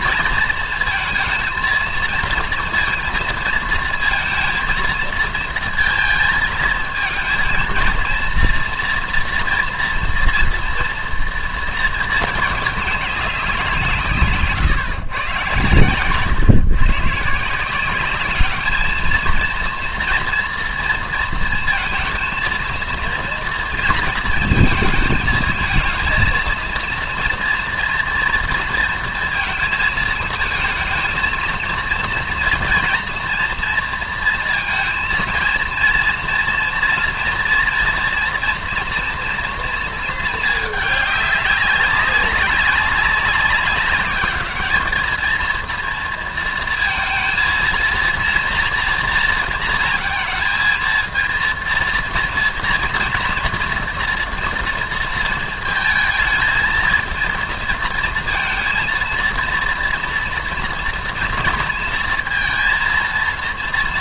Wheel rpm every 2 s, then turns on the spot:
230, 230, 230, 220, 230, 230, 220, 130, 130, 210, 230, 230, 220, 230, 240, 220, 230, 230, 230, 240, 210, 200, 210, 230, 230, 220, 230, 230, 220, 230, 230, 230.
none